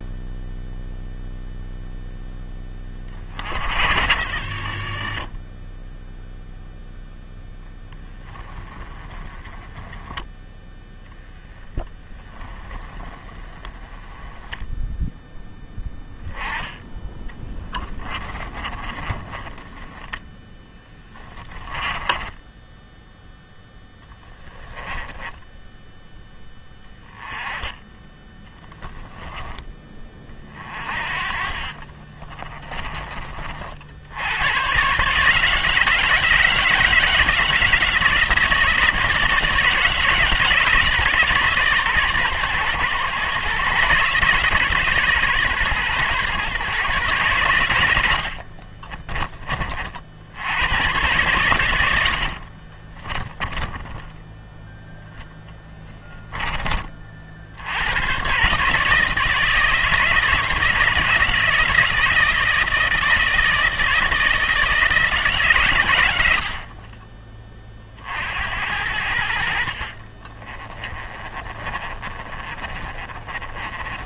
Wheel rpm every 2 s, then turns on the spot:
0, 30, 50, 0, 20, 0, 10, 0, 10, 20, 10, 10, 10, 10, 10, 40, 30, 130, 160, 160, 150, 130, 140, 130, 30, 100, 30, 20, 30, 150, 160, 160, 160, 30, 80, 20, 30.
18-22 24-26 48-50 52-54 66-68 70-74